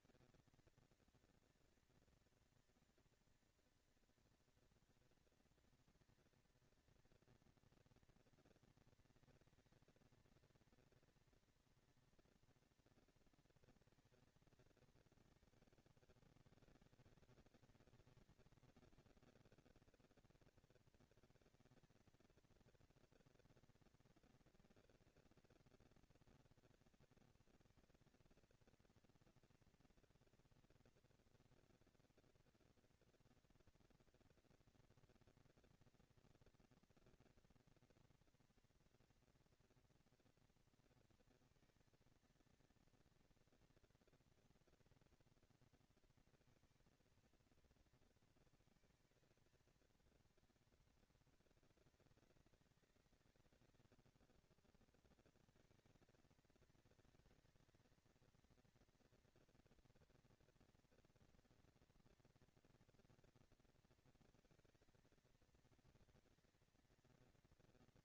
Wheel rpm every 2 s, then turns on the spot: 230, 230, 230, 230, 230, 230, 230, 220, 200, 190, 210, 230, 230, 230, 230, 230, 230, 230, 240, 240, 230, 230, 230, 230, 230, 210, 200, 210, 220, 230, 230, 230, 230, 230.
none